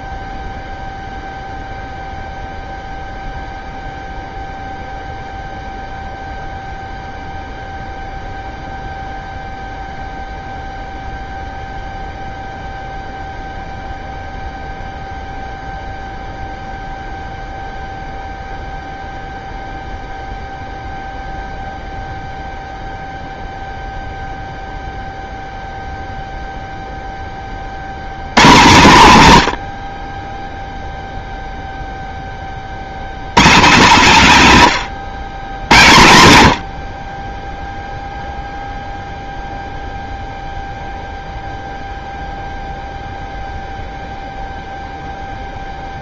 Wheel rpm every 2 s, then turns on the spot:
0, 0, 0, 0, 0, 0, 0, 0, 0, 0, 0, 0, 0, 0, 130, 0, 60, 160, 70, 0, 0, 0, 0.
none